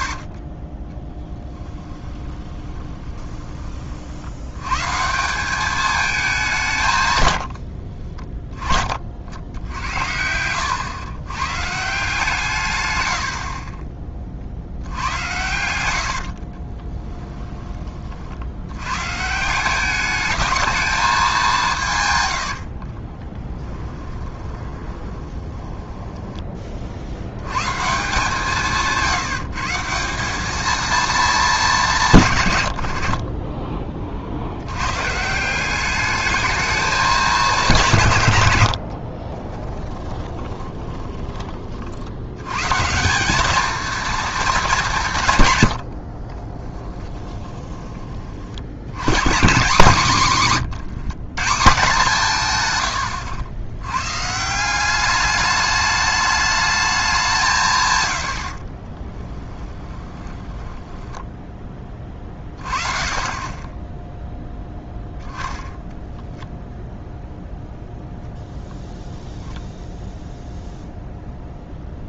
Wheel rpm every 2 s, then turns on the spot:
20, 20, 100, 170, 20, 90, 140, 60, 40, 80, 210, 80, 20, 40, 170, 210, 90, 90, 220, 80, 20, 130, 210, 30, 90, 180, 120, 190, 210, 40, 10, 30, 0, 0, 0, 0.
0-4 16-18 22-26 38-42 46-48 50-52 58-62